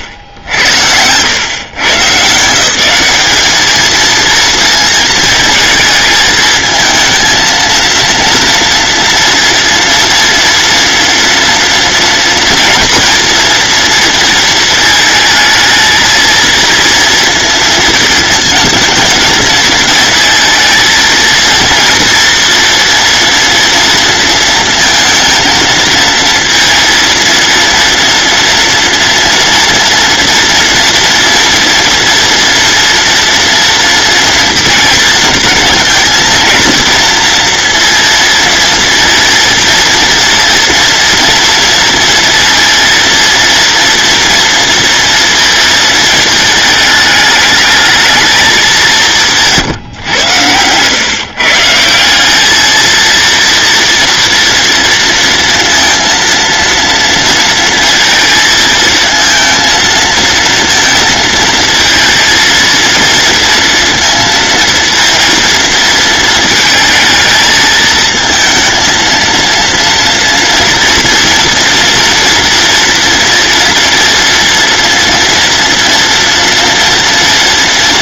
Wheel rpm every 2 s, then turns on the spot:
90, 190, 230, 220, 230, 230, 230, 220, 230, 220, 220, 240, 230, 230, 240, 230, 230, 230, 230, 230, 230, 230, 230, 220, 190, 120, 230, 230, 230, 230, 230, 230, 230, 220, 230, 230, 230, 230, 230.
none